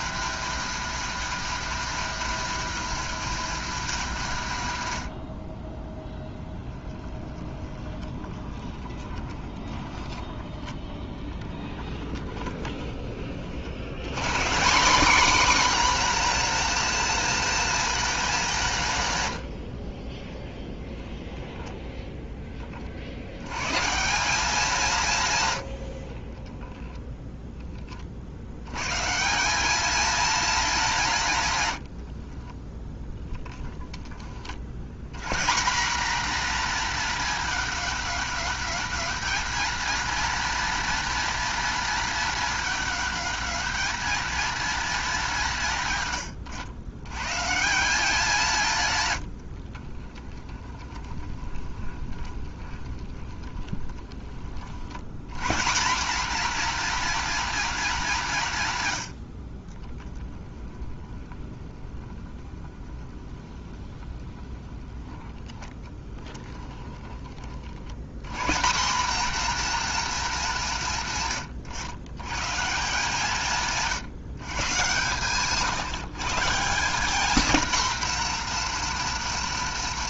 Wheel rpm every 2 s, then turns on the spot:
240, 220, 100, 10, 10, 10, 10, 200, 240, 160, 10, 50, 180, 0, 110, 190, 10, 80, 240, 220, 230, 220, 210, 110, 150, 10, 20, 70, 240, 120, 20, 20, 10, 20, 200, 160, 150, 130, 190, 240.
6-10 12-14 32-34 50-54 60-68